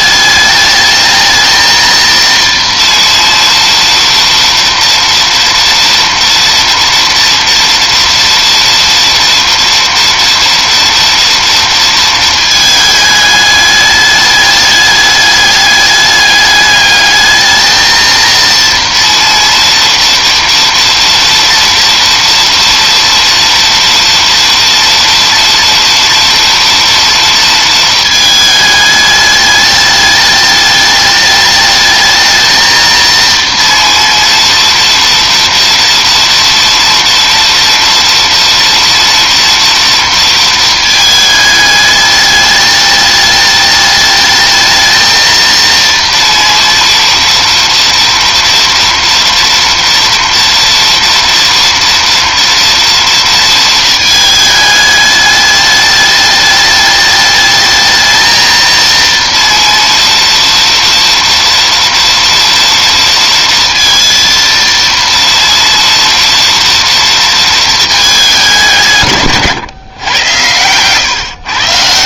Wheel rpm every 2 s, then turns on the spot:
210, 230, 230, 230, 230, 230, 230, 210, 210, 230, 230, 230, 230, 230, 220, 210, 220, 230, 230, 230, 230, 210, 210, 230, 240, 230, 240, 220, 210, 220, 230, 230, 230, 230, 210, 110.
none